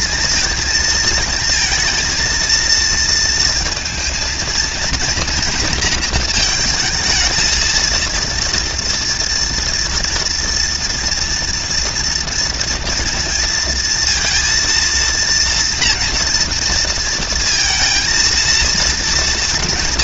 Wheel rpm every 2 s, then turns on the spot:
230, 230, 230, 230, 230, 230, 230, 230, 240, 230.
none